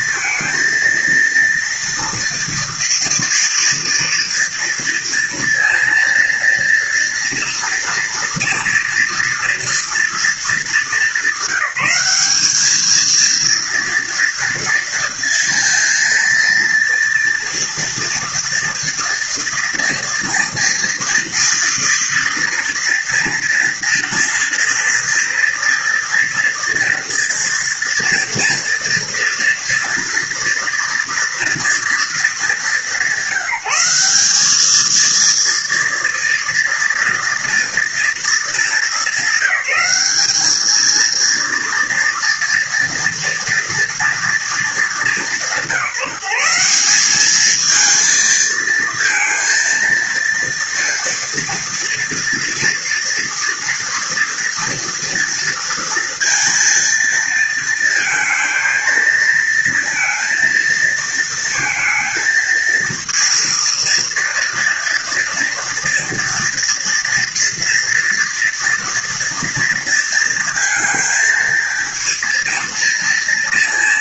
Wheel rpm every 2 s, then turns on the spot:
230, 240, 230, 230, 230, 220, 220, 230, 230, 230, 230, 230, 230, 230, 230, 230, 200, 220, 230, 220, 220, 230, 210, 180, 230, 230, 230, 230, 230, 230, 230, 230, 230, 230, 230, 230, 230.
none